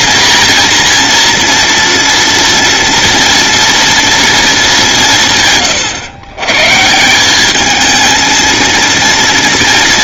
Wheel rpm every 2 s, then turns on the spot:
240, 240, 190, 150, 230.
none